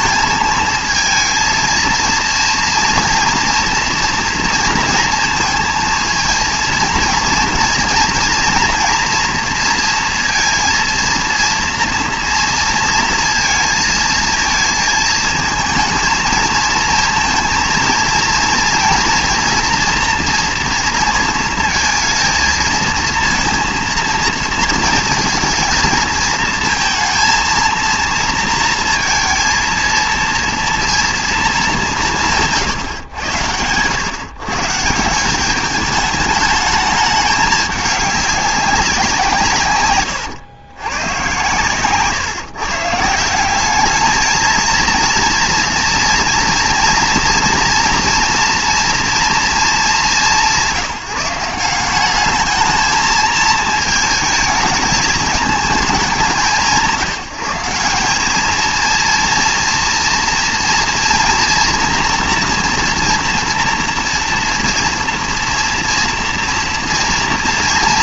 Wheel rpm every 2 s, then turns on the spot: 230, 230, 230, 230, 230, 230, 230, 230, 230, 230, 230, 230, 230, 230, 230, 230, 150, 160, 210, 190, 110, 150, 230, 240, 230, 190, 220, 220, 160, 230, 230, 240, 240, 230.
none